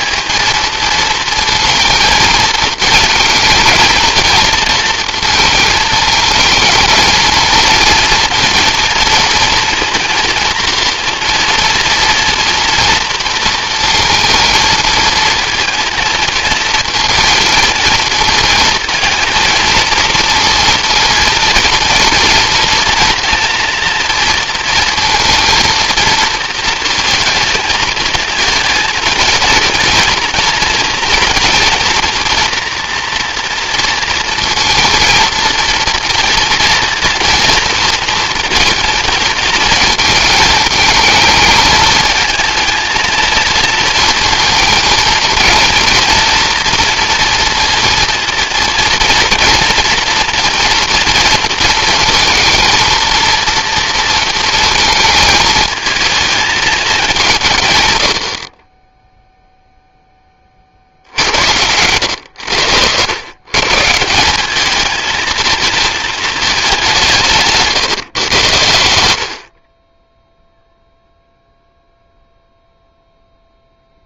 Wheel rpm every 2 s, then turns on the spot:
230, 230, 230, 220, 230, 230, 240, 220, 230, 230, 230, 230, 230, 230, 230, 230, 240, 230, 230, 230, 220, 230, 230, 230, 230, 230, 230, 220, 220, 20, 50, 90, 210, 200, 90, 0, 0.
none